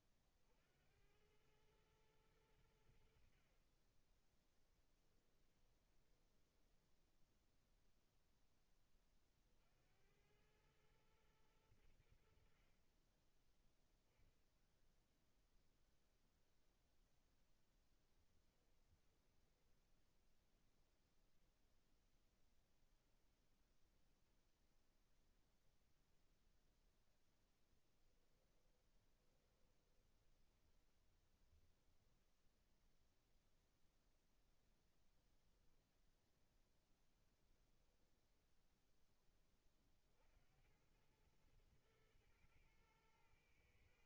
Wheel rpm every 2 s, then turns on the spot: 50, 100, 20, 10, 0, 90, 70, 0, 0, 10, 0, 0, 0, 0, 10, 20, 20, 10, 0, 0, 60, 110.
6-8 18-20 28-34